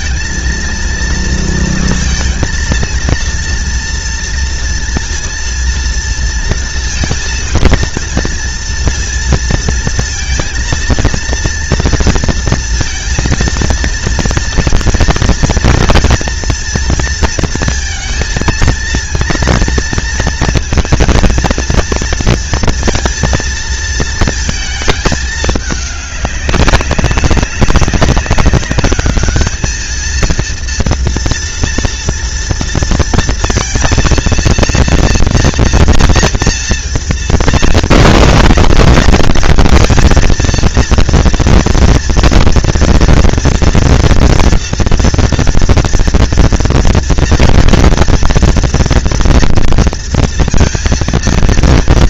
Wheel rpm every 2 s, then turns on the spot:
230, 230, 230, 230, 230, 230, 230, 230, 230, 230, 230, 230, 220, 200, 200, 230, 230, 230, 230, 230, 230, 230, 240, 230, 230, 230.
none